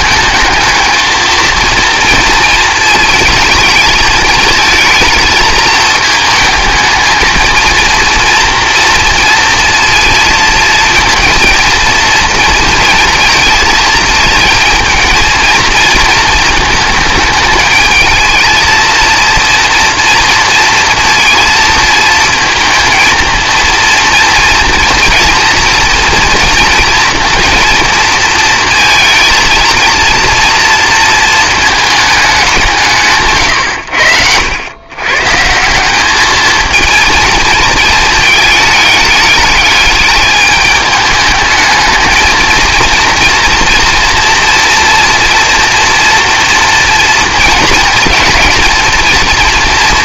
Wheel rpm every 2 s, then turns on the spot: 220, 220, 230, 220, 230, 230, 240, 220, 220, 230, 230, 220, 230, 230, 230, 230, 160, 110, 220, 210, 210, 230, 230, 230, 230.
none